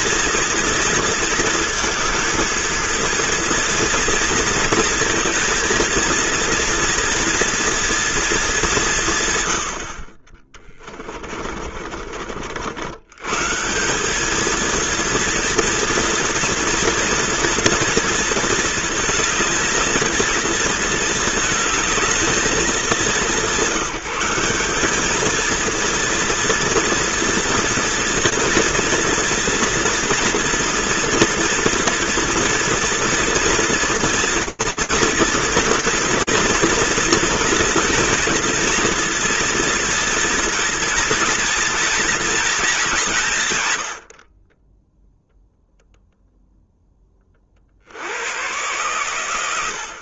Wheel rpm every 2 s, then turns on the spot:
230, 220, 230, 230, 170, 30, 90, 230, 230, 230, 230, 180, 220, 230, 230, 240, 230, 230, 230, 230, 240, 190, 0, 10, 110.
10-12